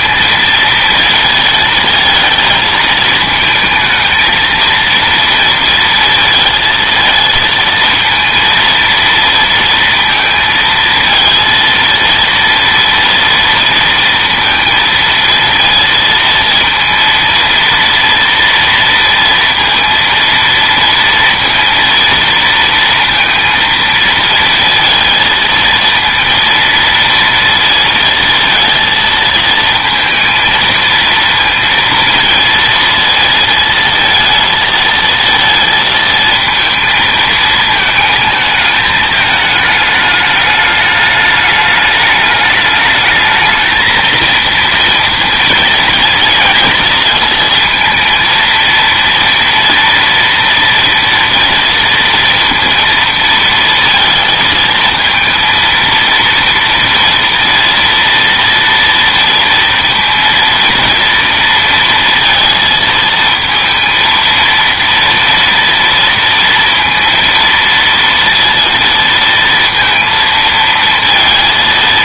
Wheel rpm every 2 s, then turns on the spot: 230, 220, 230, 230, 230, 220, 230, 230, 230, 230, 230, 230, 230, 230, 230, 230, 230, 230, 220, 220, 210, 210, 230, 230, 230, 230, 230, 230, 230, 230, 230, 220, 230, 230, 230, 230.
none